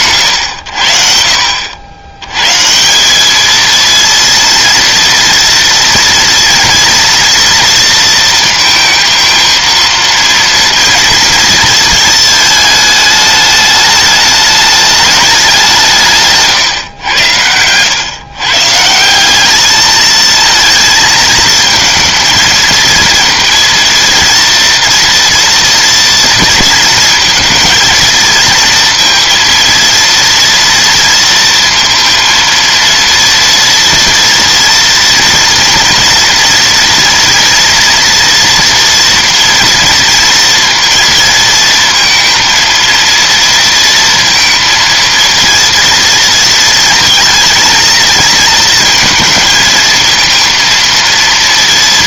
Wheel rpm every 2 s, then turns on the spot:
70, 170, 230, 230, 230, 230, 210, 210, 130, 160, 220, 230, 230, 230, 230, 230, 230, 230, 230, 230, 230, 230, 230, 230, 220, 230.
none